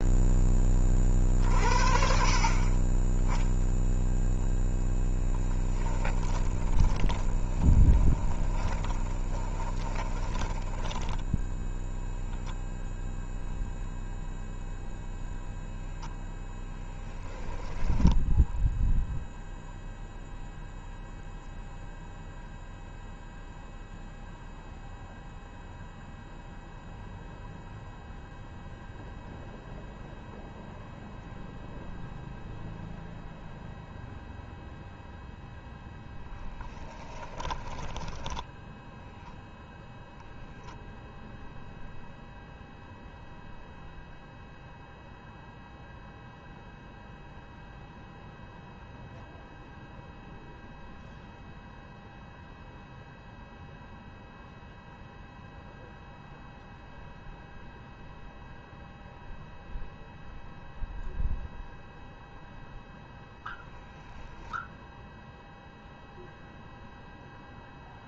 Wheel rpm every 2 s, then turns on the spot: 30, 20, 10, 20, 20, 10, 0, 0, 0, 0, 0, 0, 0, 0, 0, 0, 0, 0, 10, 10, 0, 0, 0, 0, 0, 0, 0, 0, 0, 0, 0, 0, 0, 0.
6-12 36-40